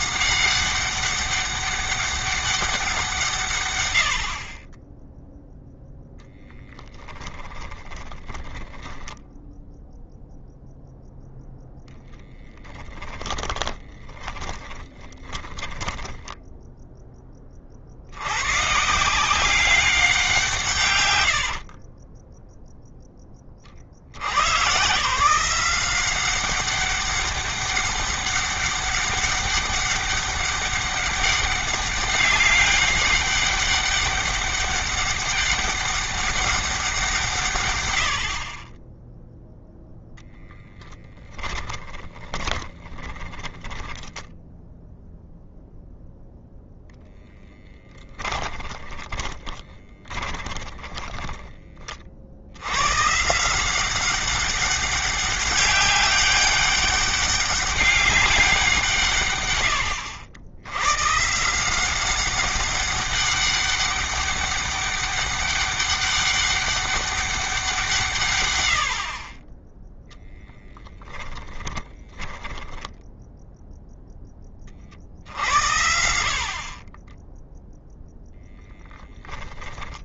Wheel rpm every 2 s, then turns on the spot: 190, 190, 50, 10, 10, 0, 10, 20, 10, 120, 170, 20, 120, 190, 200, 200, 200, 200, 200, 30, 10, 20, 10, 0, 20, 20, 90, 190, 200, 190, 100, 190, 200, 200, 110, 10, 10, 20, 40, 10.
6-10 14-18 40-46 48-52 72-74 78-80